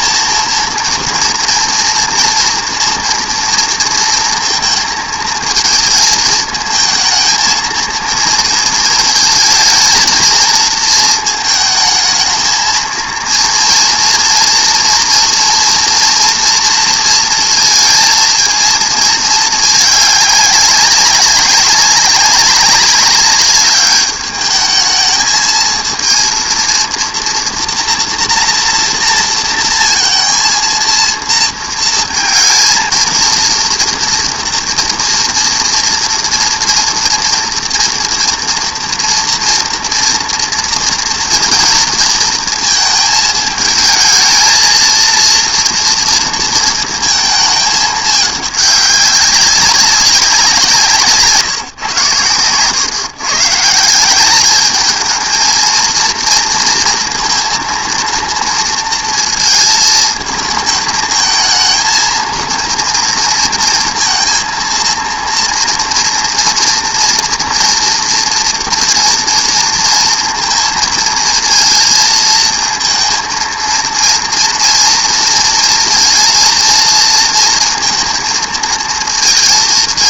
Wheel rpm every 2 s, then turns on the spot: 230, 240, 220, 220, 220, 220, 230, 230, 230, 220, 200, 200, 210, 230, 230, 230, 230, 230, 230, 230, 230, 220, 230, 220, 200, 150, 130, 220, 230, 230, 220, 230, 230, 230, 230, 220, 230, 230, 230, 230.
none